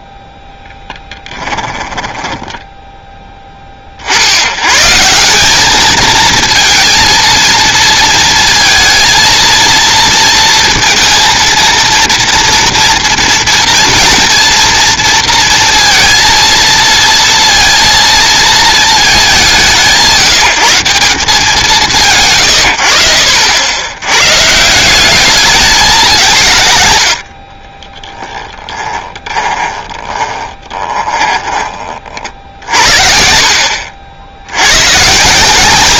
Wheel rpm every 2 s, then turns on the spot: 0, 10, 100, 230, 230, 230, 230, 230, 230, 220, 170, 100, 130, 100, 10, 10, 40, 60.
30-32